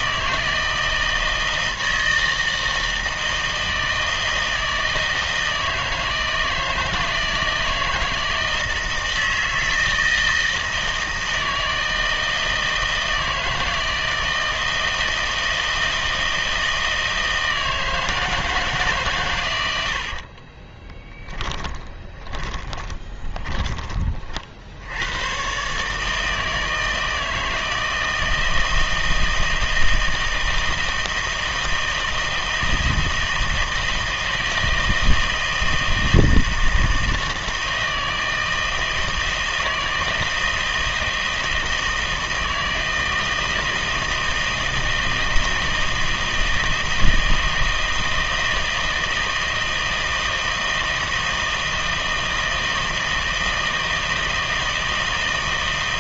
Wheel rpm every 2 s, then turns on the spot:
160, 160, 160, 160, 160, 160, 160, 160, 160, 150, 20, 20, 80, 160, 160, 160, 160, 160, 160, 160, 160, 160, 160, 160, 160, 160, 160, 160.
20-24